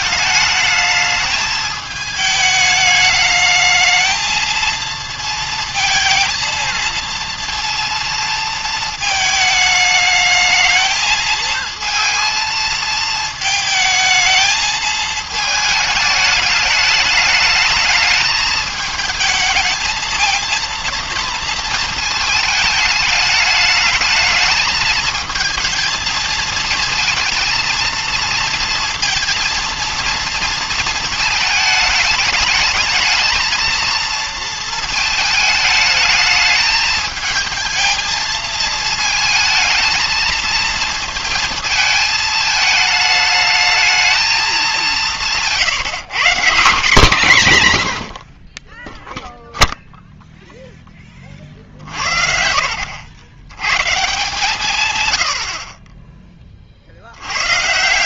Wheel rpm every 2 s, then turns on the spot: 210, 210, 230, 230, 230, 220, 220, 220, 210, 220, 230, 210, 220, 220, 230, 230, 220, 220, 220, 220, 220, 210, 200, 170, 30, 0, 60, 150, 30.
none